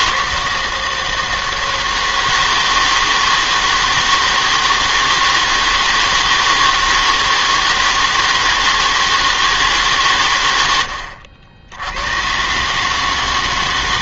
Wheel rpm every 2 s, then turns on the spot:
160, 160, 160, 160, 160, 90, 140.
none